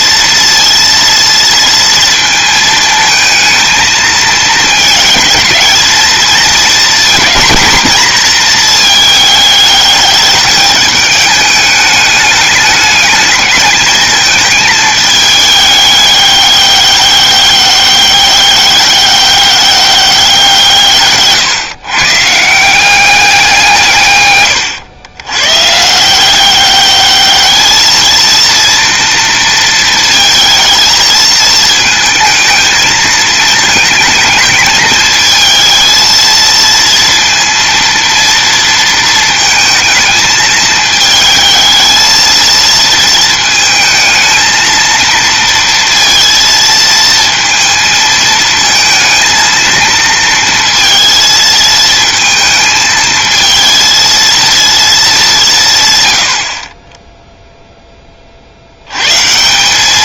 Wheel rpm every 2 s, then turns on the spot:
230, 220, 220, 230, 220, 210, 210, 220, 200, 200, 160, 180, 120, 200, 230, 220, 230, 220, 230, 230, 220, 230, 230, 230, 220, 230, 220, 220, 40, 80.
none